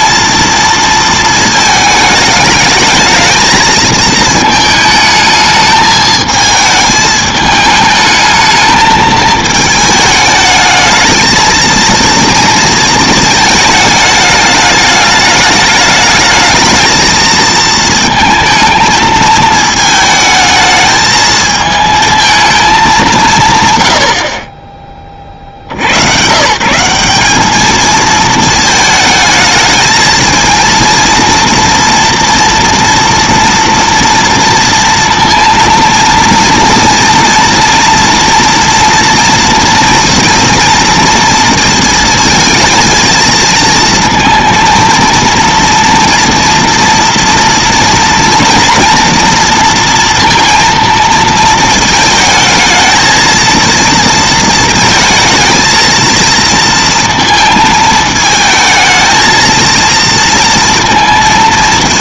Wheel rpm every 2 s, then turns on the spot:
230, 210, 220, 220, 220, 210, 230, 210, 210, 220, 220, 220, 30, 140, 220, 230, 230, 230, 230, 230, 230, 230, 230, 230, 230, 230, 230, 230, 230, 220, 230.
none